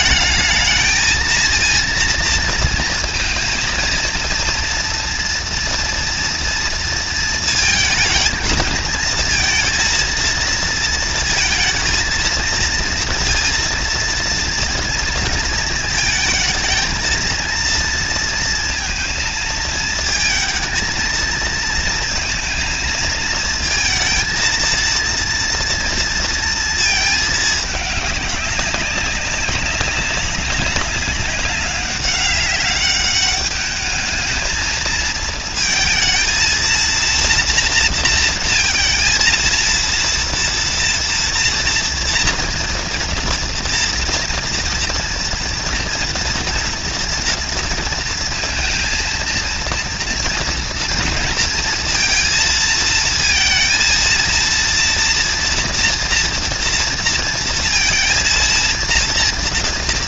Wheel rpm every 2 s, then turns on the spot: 230, 230, 230, 220, 230, 220, 230, 230, 230, 220, 220, 220, 230, 220, 200, 200, 200, 220, 230, 230, 230, 230, 230, 230, 230, 230, 230, 230, 230, 230.
none